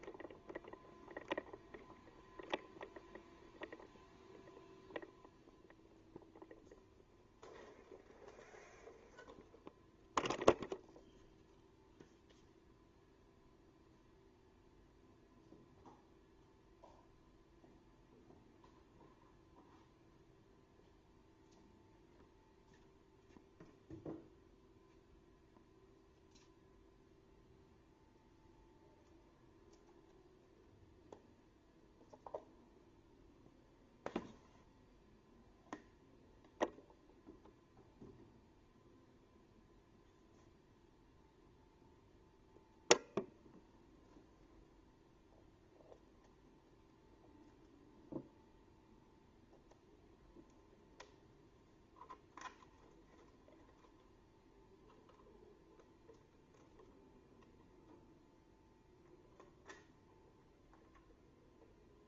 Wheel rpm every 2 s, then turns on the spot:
0, 0, 0, 0, 0, 0, 0, 0, 0, 0, 0, 0, 0, 0, 0, 0, 0, 0, 0, 0, 0, 0, 0, 0, 0, 0, 0, 0, 0, 0, 0.
none